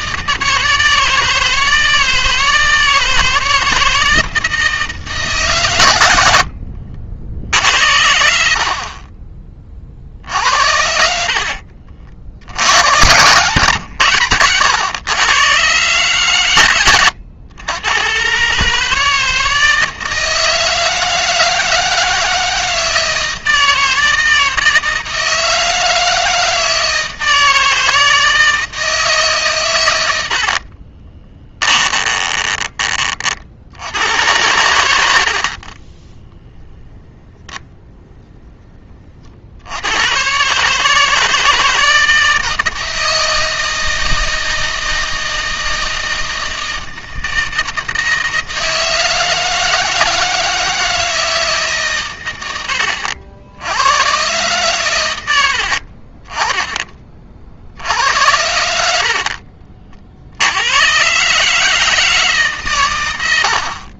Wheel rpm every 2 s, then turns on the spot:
160, 160, 160, 70, 50, 60, 100, 110, 120, 150, 160, 160, 160, 160, 160, 40, 30, 80, 10, 30, 150, 160, 160, 160, 160, 160, 90, 110, 20, 70, 110, 120.
30-32